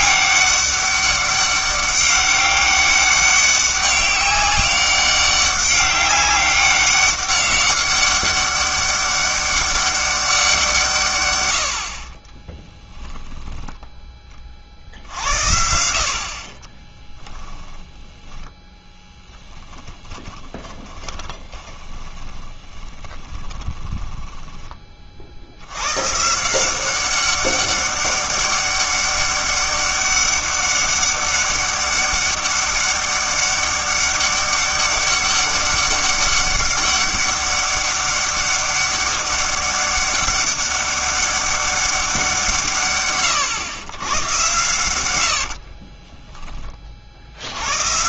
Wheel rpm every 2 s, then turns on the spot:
200, 200, 200, 200, 200, 170, 10, 50, 20, 10, 20, 30, 20, 180, 200, 200, 200, 200, 200, 200, 200, 160, 120, 20.
12-14 16-24